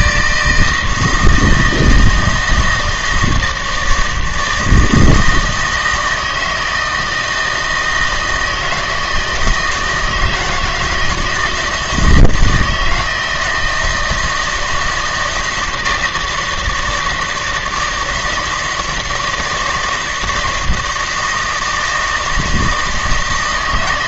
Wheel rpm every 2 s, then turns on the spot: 160, 160, 160, 160, 160, 170, 160, 160, 160, 160, 160, 160.
none